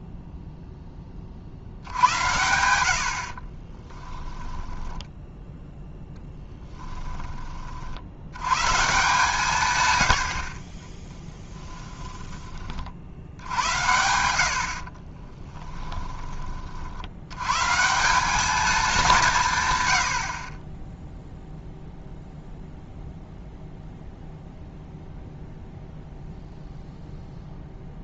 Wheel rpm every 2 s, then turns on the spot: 10, 80, 10, 10, 140, 30, 50, 40, 60, 200, 10, 0, 0, 0.
6-8 14-16